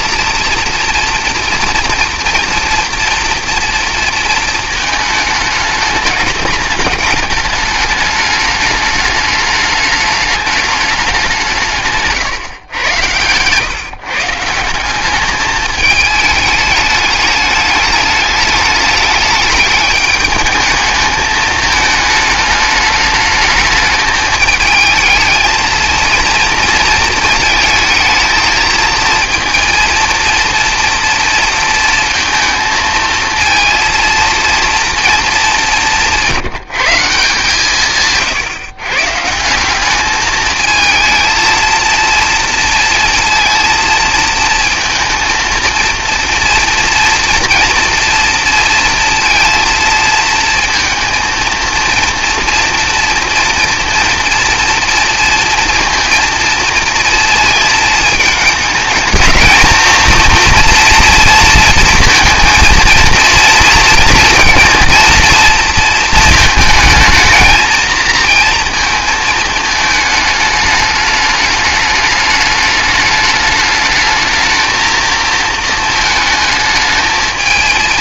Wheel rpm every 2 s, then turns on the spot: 230, 230, 220, 210, 210, 210, 110, 180, 210, 210, 210, 210, 220, 230, 230, 230, 230, 230, 170, 130, 230, 230, 220, 230, 230, 220, 230, 230, 230, 220, 230, 230, 230, 220, 230, 210, 210, 230, 220.
none